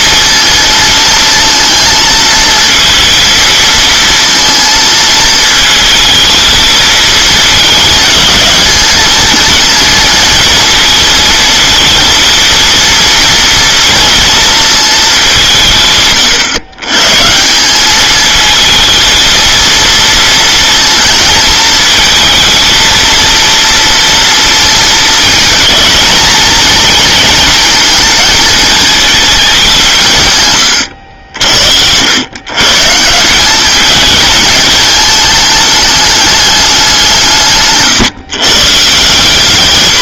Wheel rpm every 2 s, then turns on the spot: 230, 230, 230, 220, 220, 230, 230, 220, 120, 220, 230, 230, 230, 230, 220, 90, 140, 220, 190, 150.
none